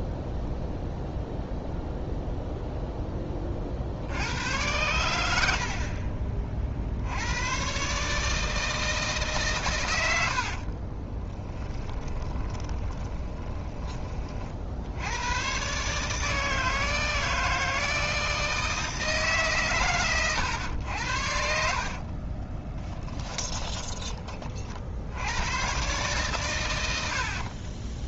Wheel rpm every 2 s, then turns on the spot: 0, 0, 100, 60, 160, 40, 20, 70, 160, 160, 100, 20, 50, 80.
10-14 22-24 26-28